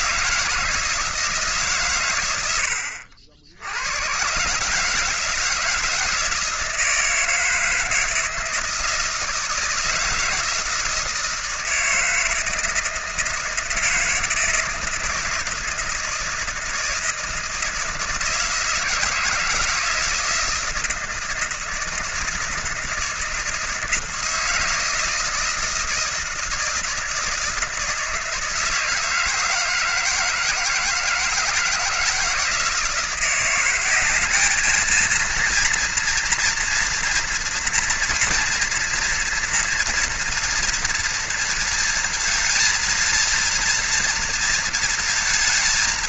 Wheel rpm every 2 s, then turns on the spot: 160, 100, 130, 160, 160, 160, 160, 160, 160, 160, 160, 160, 160, 160, 160, 160, 160, 210, 230, 230, 230, 220, 230.
none